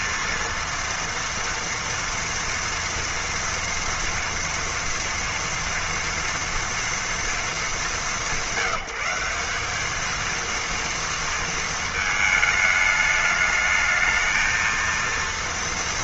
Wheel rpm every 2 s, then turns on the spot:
230, 230, 230, 230, 190, 230, 210, 230.
none